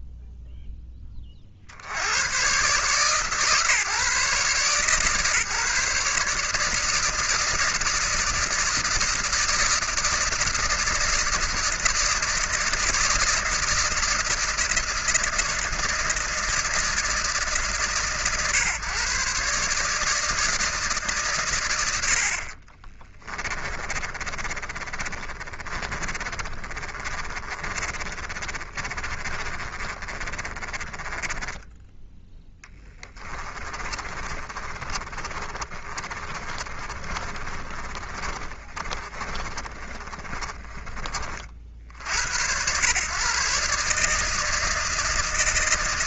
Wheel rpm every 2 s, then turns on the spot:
10, 130, 150, 160, 160, 160, 160, 160, 160, 140, 150, 30, 40, 30, 30, 20, 10, 30, 40, 40, 30, 110, 160.
22-42